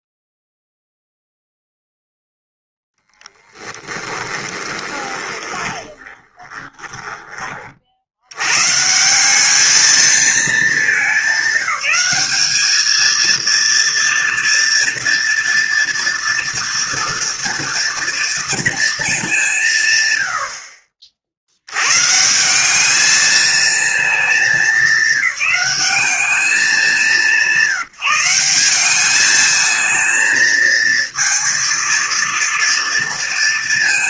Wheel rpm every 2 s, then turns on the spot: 0, 10, 20, 20, 180, 210, 230, 230, 230, 200, 60, 220, 190, 190, 210, 230, 230.
2-6